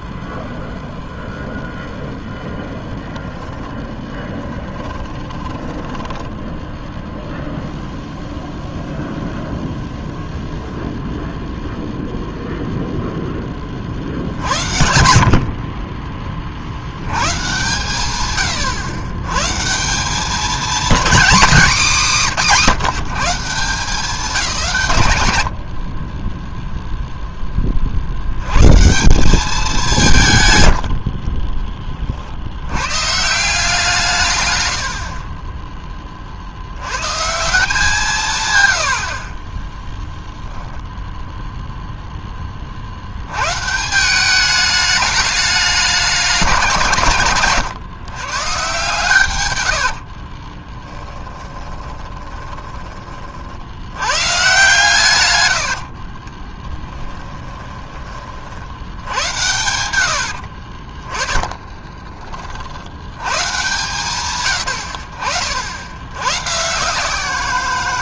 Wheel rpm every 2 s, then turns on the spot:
0, 10, 10, 0, 0, 0, 0, 80, 70, 120, 240, 170, 150, 0, 150, 60, 100, 60, 100, 70, 0, 50, 210, 160, 130, 20, 20, 140, 20, 80, 30, 70, 90, 150.
4-6 50-54 56-58 60-62